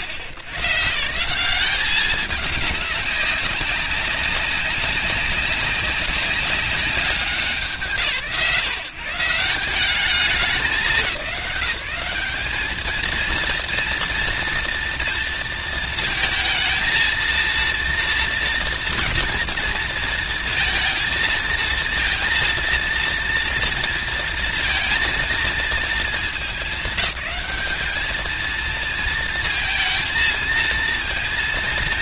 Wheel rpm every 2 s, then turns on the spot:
90, 200, 190, 200, 130, 190, 210, 230, 220, 230, 230, 230, 230, 210, 220, 220.
none